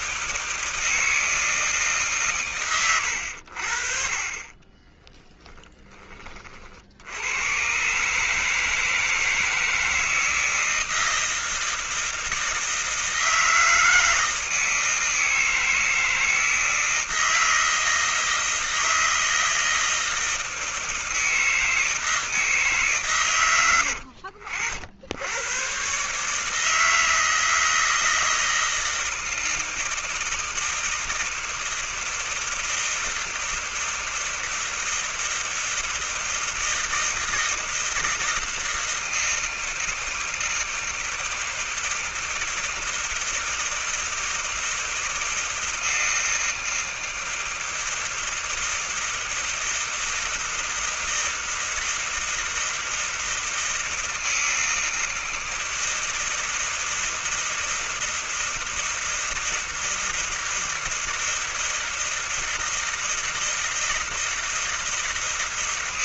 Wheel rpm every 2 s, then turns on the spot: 160, 130, 50, 20, 130, 160, 160, 160, 160, 160, 160, 160, 80, 140, 160, 160, 160, 160, 160, 160, 160, 160, 160, 160, 160, 160, 160, 160, 160, 160, 160, 160, 160.
none